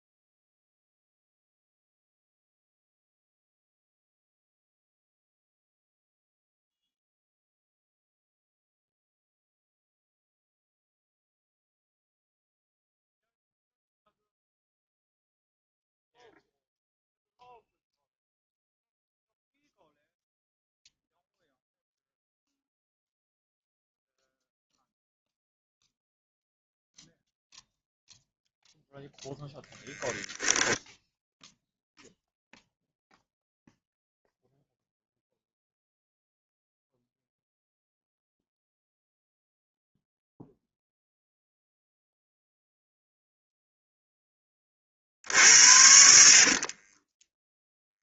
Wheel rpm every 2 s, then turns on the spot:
0, 0, 0, 0, 0, 0, 0, 0, 0, 0, 0, 0, 0, 0, 0, 0, 0, 0, 0, 0, 0, 0, 40, 30.
46-48